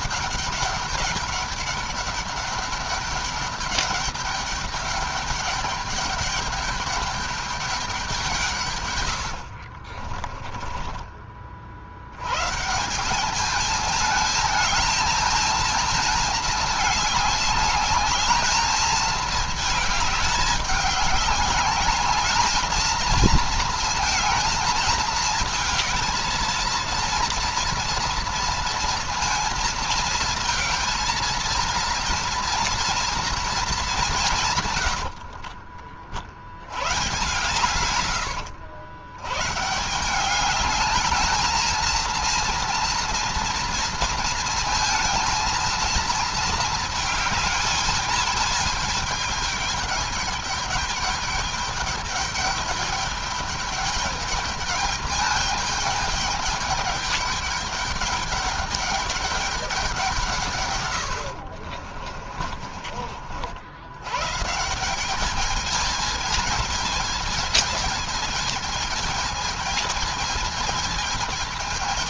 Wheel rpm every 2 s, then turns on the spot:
200, 200, 200, 210, 120, 20, 170, 220, 210, 220, 200, 220, 220, 230, 230, 220, 230, 120, 120, 100, 210, 230, 230, 220, 210, 210, 200, 210, 200, 210, 120, 40, 180, 220, 220, 220.
10-12 34-36